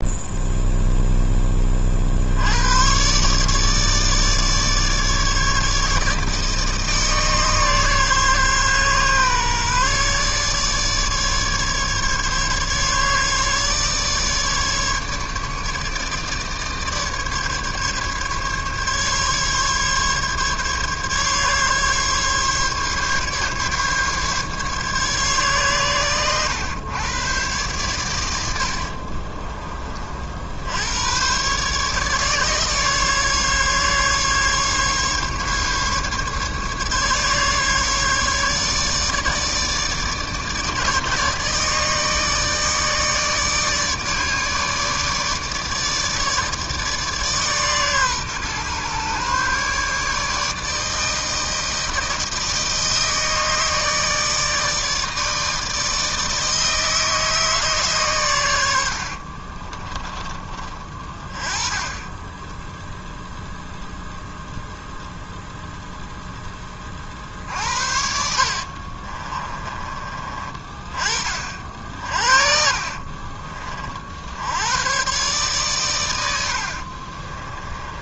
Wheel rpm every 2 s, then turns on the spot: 0, 90, 150, 150, 140, 150, 140, 150, 150, 140, 140, 140, 140, 110, 80, 70, 150, 140, 140, 150, 150, 150, 150, 150, 130, 150, 160, 150, 160, 100, 20, 10, 0, 10, 50, 30, 60, 80, 70.
68-70 72-74 76-78